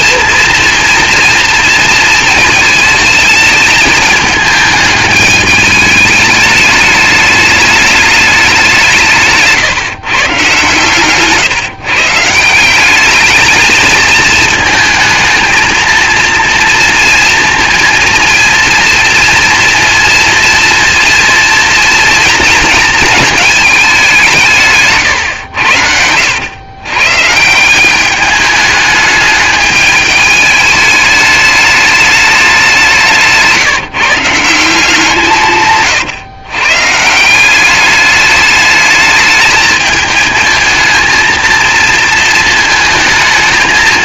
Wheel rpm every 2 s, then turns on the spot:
230, 220, 220, 210, 190, 140, 180, 230, 230, 230, 230, 230, 150, 100, 210, 210, 190, 170, 130, 210, 220, 220.
none